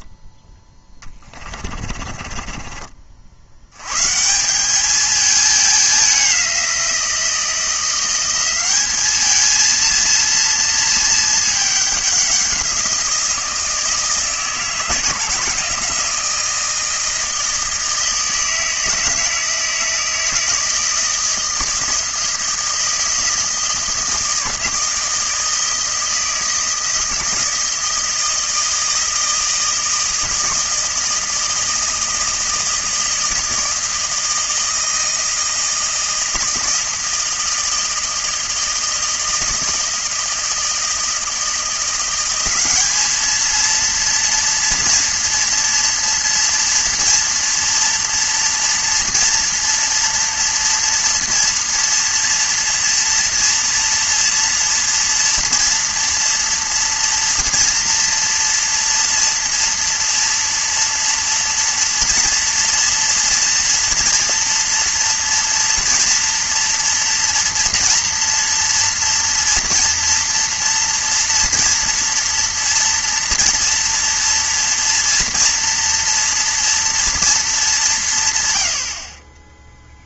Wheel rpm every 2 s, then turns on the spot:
20, 50, 210, 170, 210, 220, 170, 160, 160, 160, 160, 160, 160, 160, 160, 160, 160, 160, 160, 160, 160, 210, 230, 230, 230, 230, 230, 230, 230, 230, 230, 230, 230, 230, 230, 230, 240, 230, 230, 60.
0-2